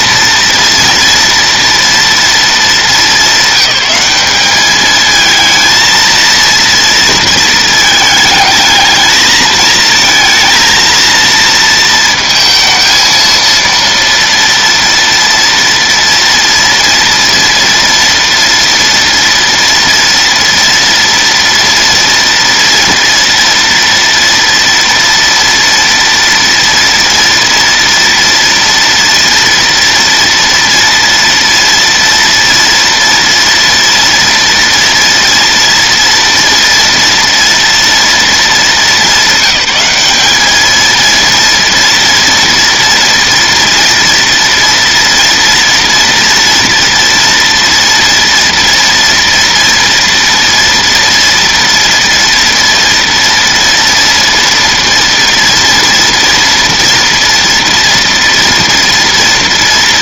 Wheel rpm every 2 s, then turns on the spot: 230, 210, 220, 230, 220, 230, 220, 230, 230, 230, 230, 230, 230, 240, 230, 230, 230, 230, 230, 220, 230, 240, 230, 230, 230, 230, 230, 230, 230, 230.
none